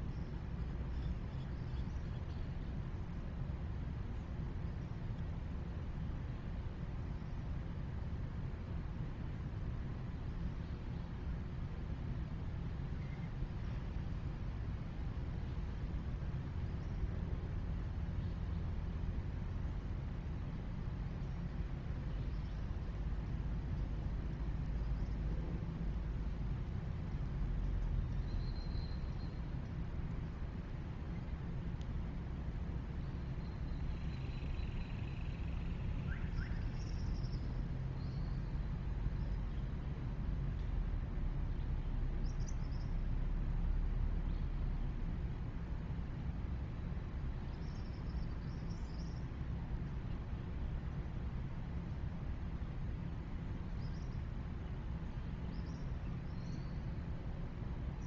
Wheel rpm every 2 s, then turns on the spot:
0, 0, 0, 0, 0, 0, 0, 0, 0, 0, 0, 0, 0, 0, 0, 0, 0, 0, 0, 0, 0, 0, 0, 0, 0, 0, 0, 0, 0.
none